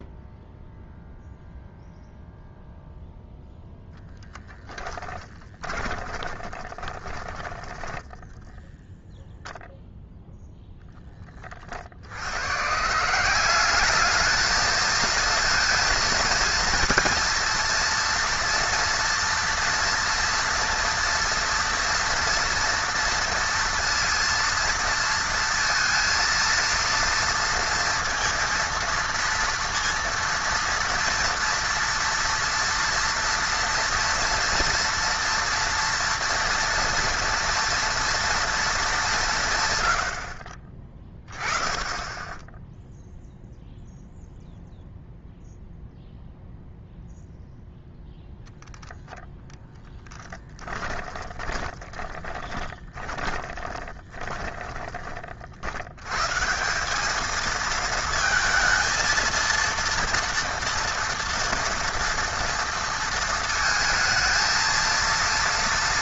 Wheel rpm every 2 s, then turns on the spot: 0, 0, 10, 20, 0, 0, 140, 220, 230, 240, 240, 230, 230, 230, 230, 230, 230, 230, 230, 210, 30, 0, 0, 0, 0, 40, 20, 20, 190, 220, 230, 230, 230.
4-8 50-54